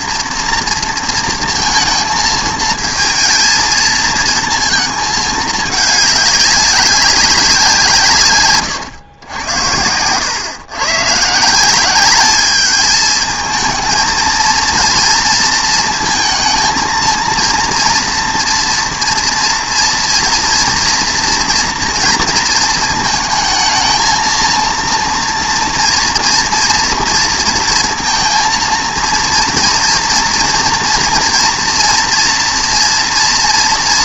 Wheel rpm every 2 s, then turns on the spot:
230, 220, 220, 190, 110, 130, 210, 230, 230, 230, 230, 220, 230, 230, 230, 230, 230.
none